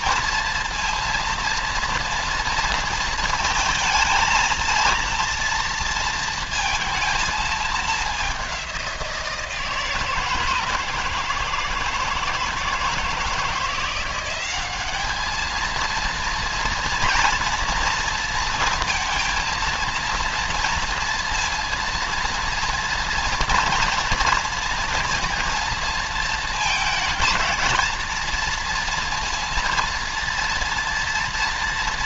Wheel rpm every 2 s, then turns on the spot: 230, 230, 230, 230, 190, 160, 160, 200, 230, 230, 230, 230, 230, 230, 230, 230.
none